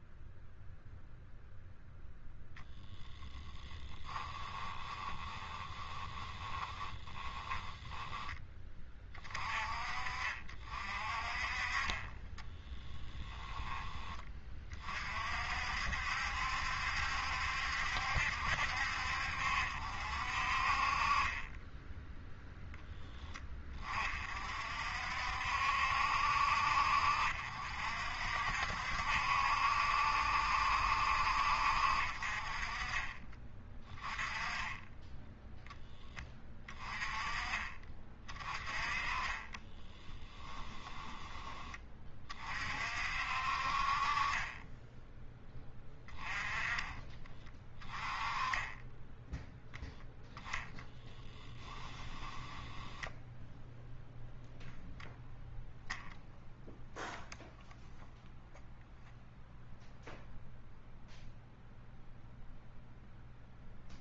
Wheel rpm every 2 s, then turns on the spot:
0, 0, 10, 30, 10, 50, 10, 30, 70, 70, 50, 0, 50, 60, 60, 70, 40, 20, 20, 30, 10, 40, 30, 20, 20, 0, 10, 0, 0, 0, 0, 0.
4-8 12-14 40-42 44-46 52-54